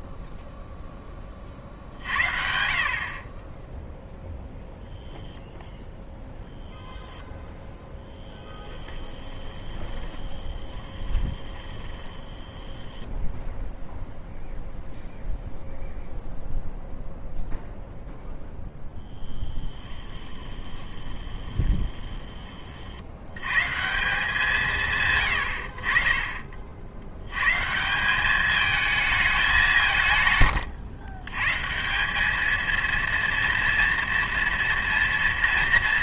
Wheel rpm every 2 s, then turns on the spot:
0, 50, 0, 0, 20, 20, 10, 0, 0, 0, 20, 70, 120, 70, 220, 110, 230, 230.
8-14 20-22 30-32